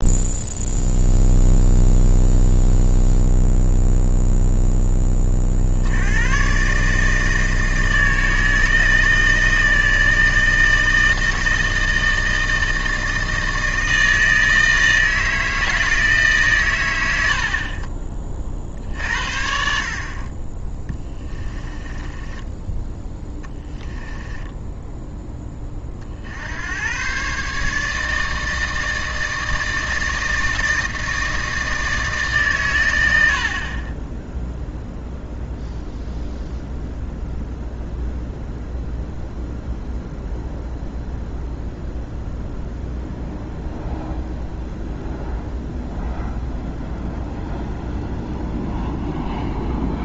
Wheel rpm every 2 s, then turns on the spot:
0, 0, 40, 160, 160, 160, 160, 160, 70, 60, 20, 10, 10, 140, 160, 160, 60, 0, 0, 0, 0, 0, 0, 0, 0.
20-24